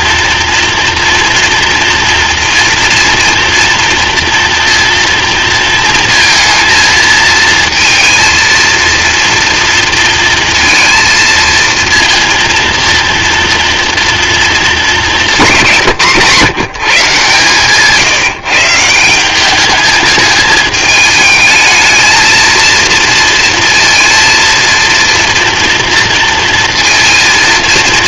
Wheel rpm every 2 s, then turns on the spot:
230, 230, 230, 230, 230, 230, 230, 230, 160, 180, 220, 230, 230, 230.
none